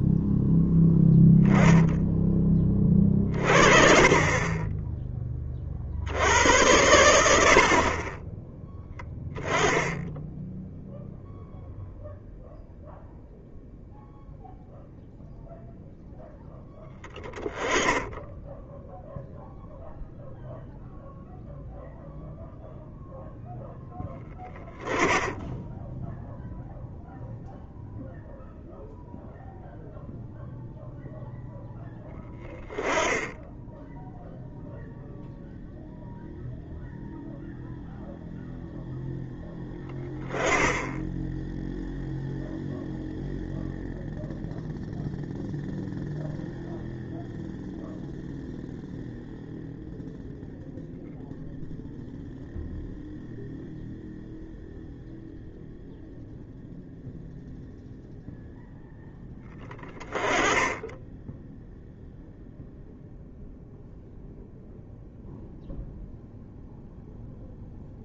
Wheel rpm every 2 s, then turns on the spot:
0, 20, 20, 100, 10, 10, 0, 0, 0, 10, 0, 0, 10, 0, 0, 0, 10, 0, 0, 0, 10, 0, 0, 0, 0, 0, 0, 0, 0, 0, 10, 0, 0, 0.
none